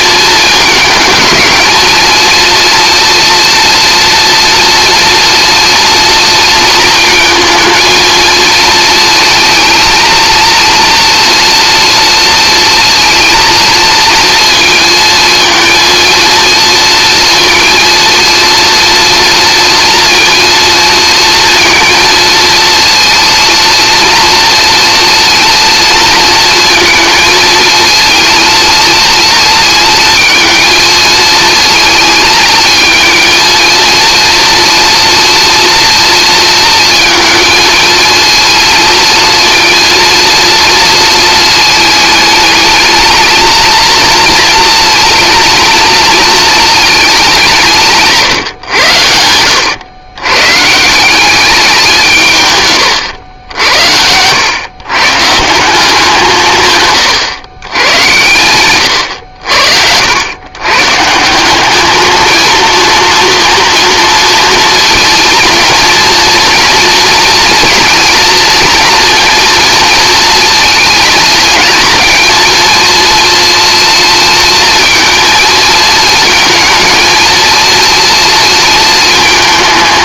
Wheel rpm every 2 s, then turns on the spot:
220, 230, 230, 230, 220, 230, 230, 230, 230, 230, 230, 230, 230, 230, 230, 220, 220, 230, 230, 230, 230, 220, 230, 220, 110, 140, 130, 110, 150, 110, 120, 230, 230, 230, 230, 230, 230, 230, 230, 230.
none